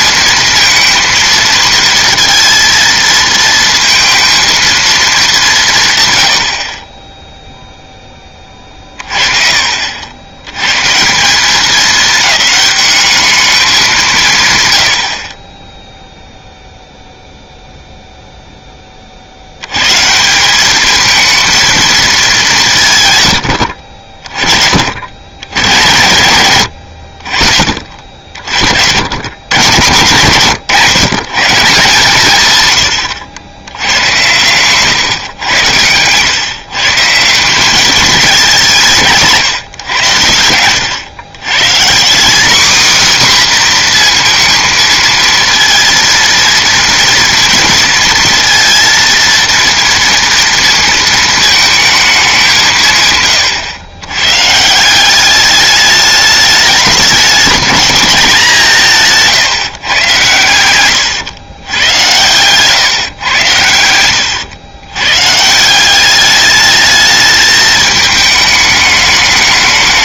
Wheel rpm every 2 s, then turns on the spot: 230, 230, 230, 40, 30, 130, 210, 120, 0, 10, 200, 170, 50, 100, 70, 140, 110, 120, 140, 190, 90, 250, 230, 230, 230, 220, 170, 150, 210, 180, 100, 120, 110, 210, 210.
8-10